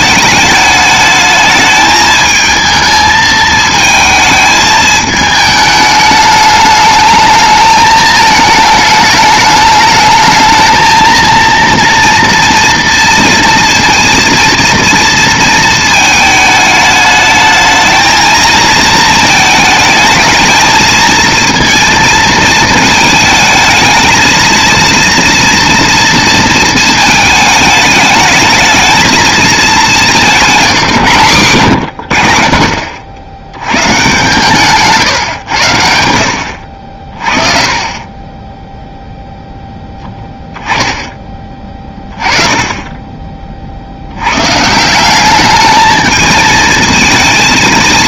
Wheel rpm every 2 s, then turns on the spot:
210, 220, 220, 210, 210, 220, 230, 230, 210, 220, 220, 220, 230, 230, 220, 170, 60, 140, 60, 0, 10, 20, 170, 220.
none